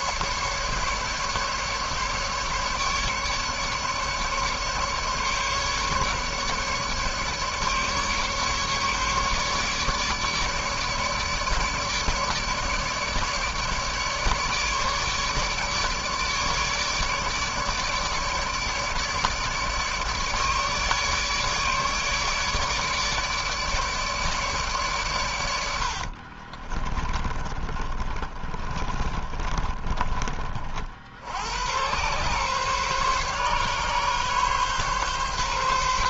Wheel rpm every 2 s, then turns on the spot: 150, 140, 150, 140, 150, 150, 150, 150, 150, 150, 150, 150, 150, 50, 30, 30, 110, 140.
26-30